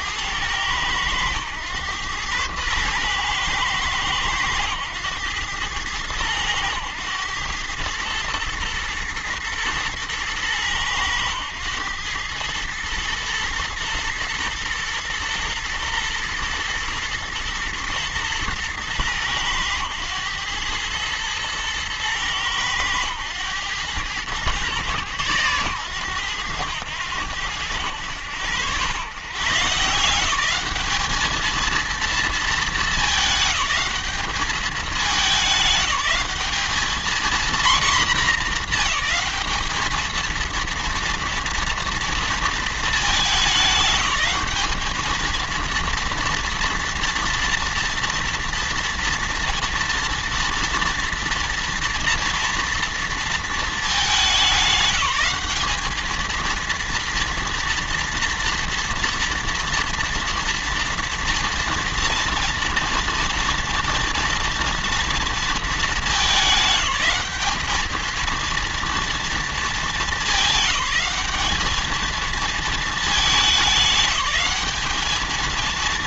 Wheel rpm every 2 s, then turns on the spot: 100, 110, 110, 110, 110, 110, 110, 120, 110, 110, 110, 110, 110, 90, 100, 200, 220, 210, 220, 230, 230, 220, 210, 240, 230, 230, 230, 190, 230, 230, 230, 230, 230, 200, 230, 200, 220, 210.
none